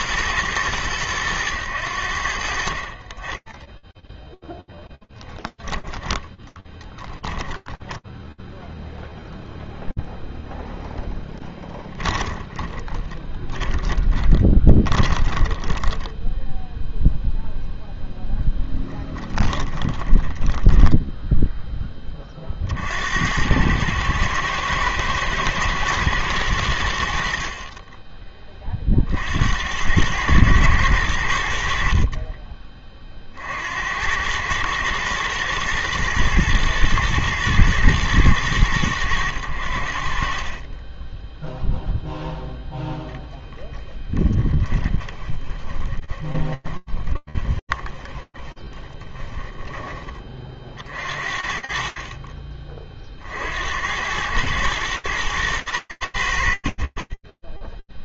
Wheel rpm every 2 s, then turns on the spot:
100, 10, 10, 0, 0, 20, 20, 10, 0, 20, 20, 100, 110, 30, 100, 40, 90, 110, 110, 50, 0, 10, 20, 30, 30, 40, 110, 80, 0.
4-6 10-16 18-20 42-48